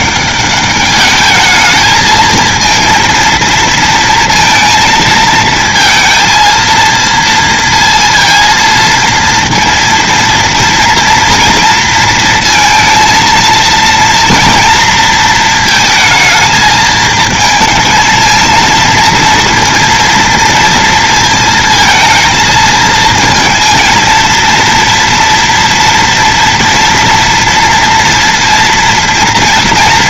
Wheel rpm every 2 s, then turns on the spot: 210, 230, 220, 230, 230, 240, 230, 230, 220, 230, 230, 220, 230, 230, 230.
none